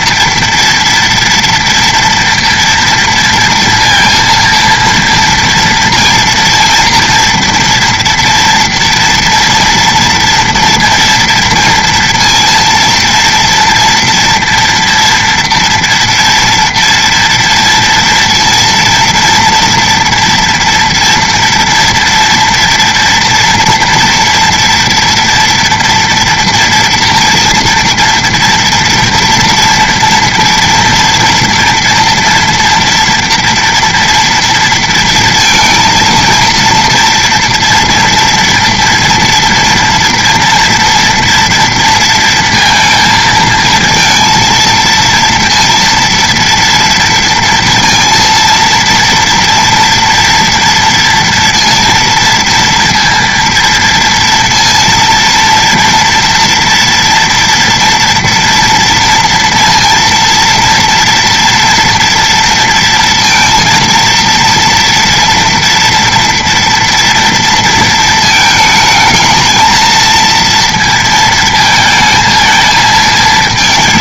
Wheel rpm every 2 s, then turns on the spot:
230, 230, 230, 230, 230, 230, 230, 240, 240, 230, 230, 230, 230, 230, 230, 230, 230, 230, 230, 230, 240, 230, 230, 230, 230, 230, 230, 230, 240, 240, 230, 230, 230, 240, 220, 230, 230.
none